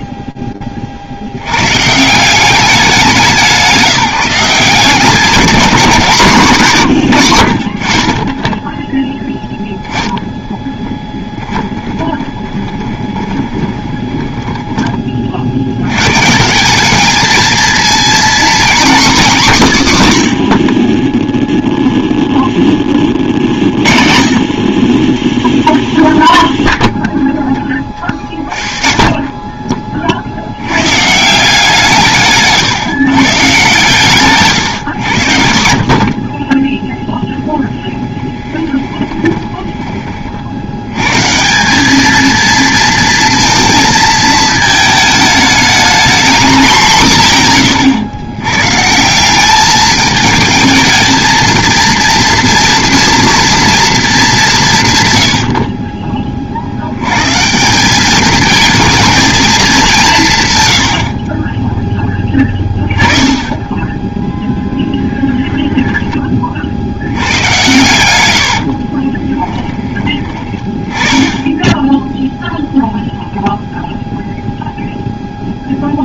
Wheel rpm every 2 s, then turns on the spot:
40, 190, 170, 150, 10, 10, 20, 30, 200, 250, 30, 30, 20, 0, 30, 140, 150, 90, 10, 20, 110, 230, 220, 190, 160, 220, 230, 120, 90, 220, 80, 20, 10, 80, 40, 20, 0, 0.
10-14 34-40 64-66 68-70